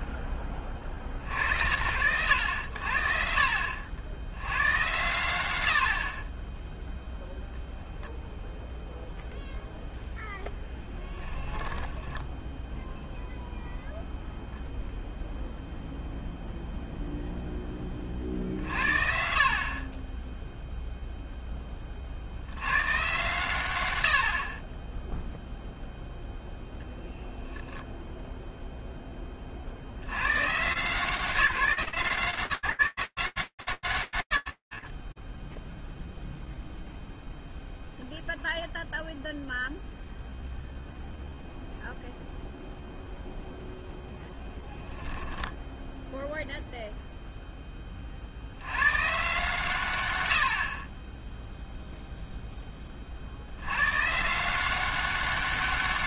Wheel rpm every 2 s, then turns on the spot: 10, 90, 100, 10, 0, 10, 0, 0, 0, 60, 0, 120, 30, 10, 10, 160, 160, 30, 0, 0, 0, 0, 10, 20, 120, 0, 90, 200.
10-12